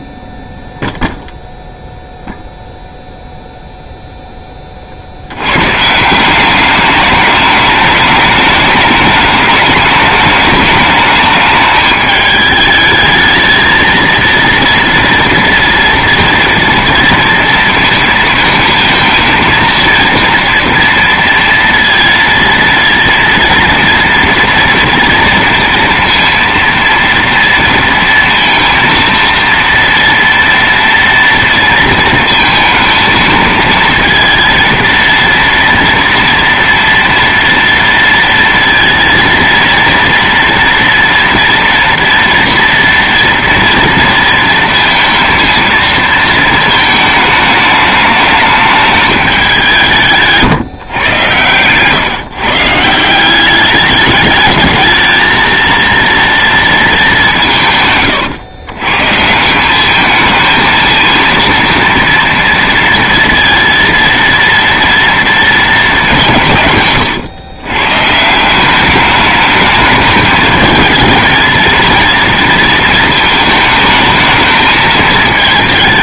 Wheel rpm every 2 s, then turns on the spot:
0, 0, 30, 200, 210, 210, 220, 230, 230, 220, 230, 230, 230, 230, 230, 230, 220, 230, 230, 230, 230, 230, 230, 220, 210, 140, 160, 220, 220, 130, 230, 230, 230, 140, 190, 220, 230, 220.
none